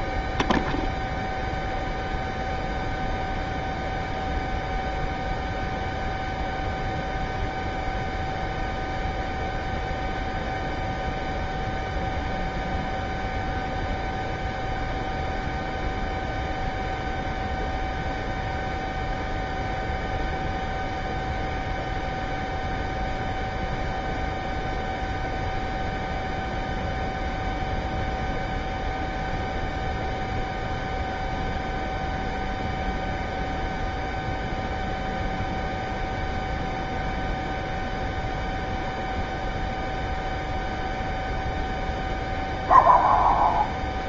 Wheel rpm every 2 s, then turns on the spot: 0, 0, 0, 0, 0, 0, 0, 0, 0, 0, 0, 0, 0, 0, 0, 0, 0, 0, 0, 0, 0, 0.
none